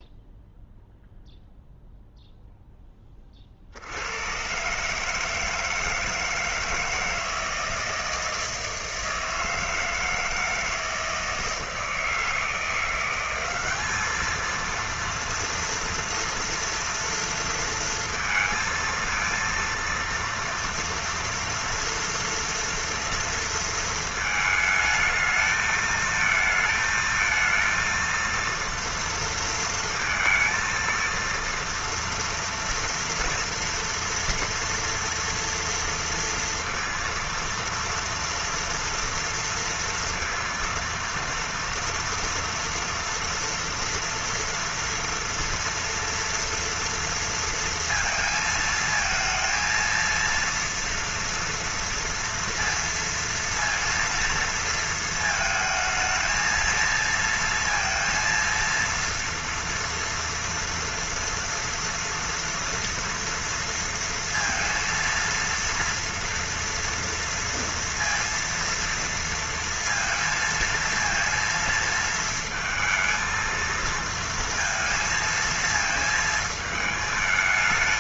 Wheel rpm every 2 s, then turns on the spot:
0, 10, 130, 160, 160, 160, 170, 230, 230, 230, 230, 230, 220, 220, 230, 230, 230, 230, 230, 230, 230, 230, 230, 230, 220, 230, 230, 230, 230, 230, 230, 230, 230, 230, 230, 230, 230, 230, 220.
none